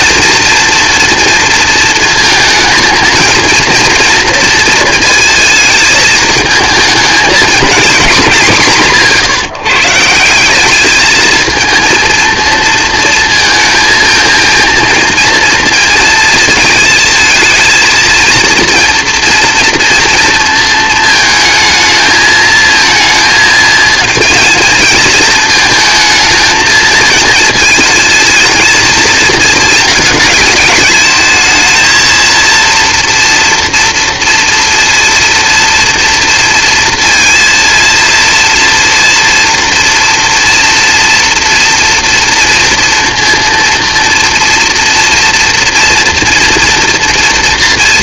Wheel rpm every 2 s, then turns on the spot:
240, 220, 230, 220, 170, 200, 230, 230, 230, 230, 220, 230, 220, 230, 220, 210, 230, 230, 230, 230, 230, 240, 230, 240.
none